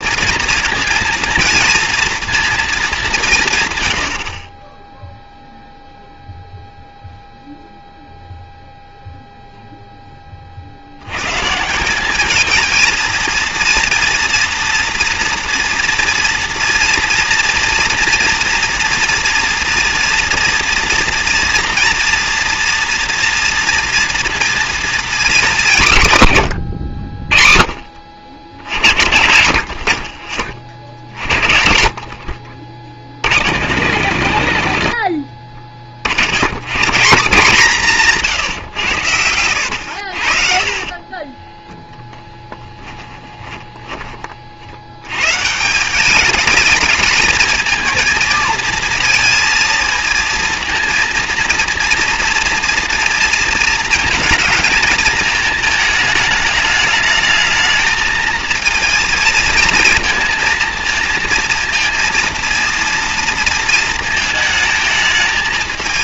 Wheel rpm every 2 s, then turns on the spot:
230, 230, 50, 0, 0, 30, 210, 240, 230, 230, 230, 230, 230, 130, 60, 40, 50, 70, 90, 160, 70, 10, 40, 210, 230, 230, 230, 220, 210, 220, 230, 230, 220.
42-44